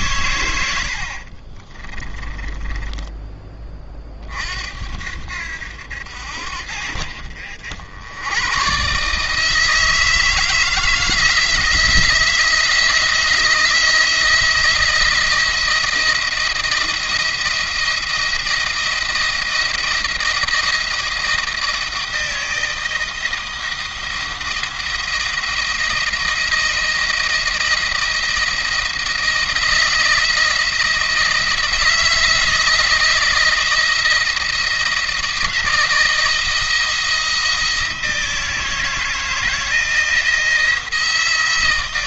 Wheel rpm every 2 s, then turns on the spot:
70, 20, 70, 60, 130, 160, 160, 170, 170, 170, 170, 170, 170, 160, 170, 170, 170, 170, 170, 160, 170.
0-4